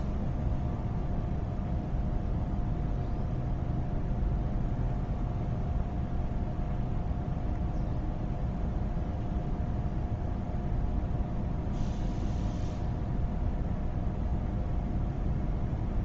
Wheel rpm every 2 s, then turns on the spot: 0, 0, 0, 0, 0, 0, 0, 0.
none